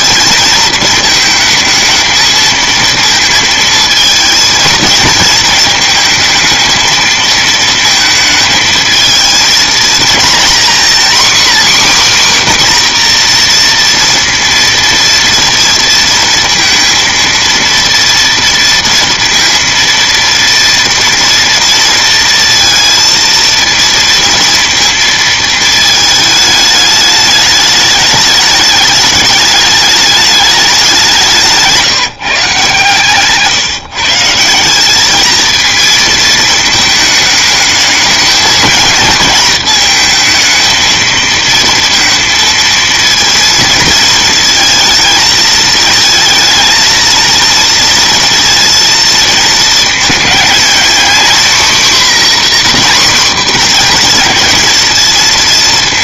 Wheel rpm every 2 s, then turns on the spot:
220, 220, 220, 220, 220, 250, 250, 230, 230, 230, 230, 230, 230, 210, 210, 190, 140, 200, 220, 230, 230, 230, 220, 230, 230, 240, 260, 230.
none